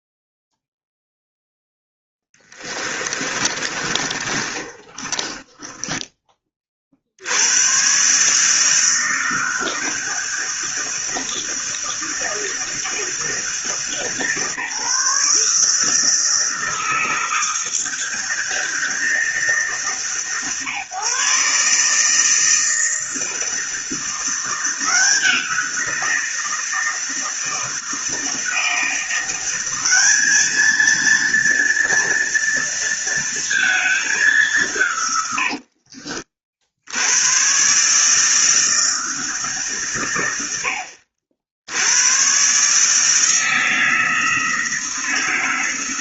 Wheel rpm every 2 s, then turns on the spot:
0, 10, 30, 30, 150, 160, 160, 150, 160, 160, 130, 160, 170, 170, 160, 220, 230, 190, 50, 160, 90, 130, 160.
2-6